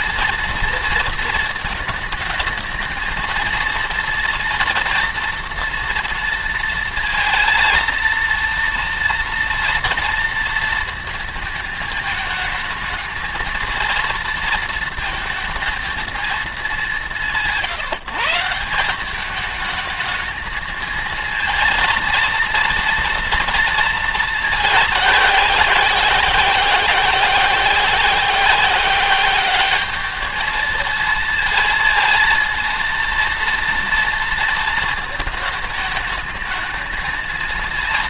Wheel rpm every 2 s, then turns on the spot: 230, 220, 230, 230, 230, 230, 220, 230, 210, 170, 220, 230, 210, 180, 190, 210, 230, 230, 220.
none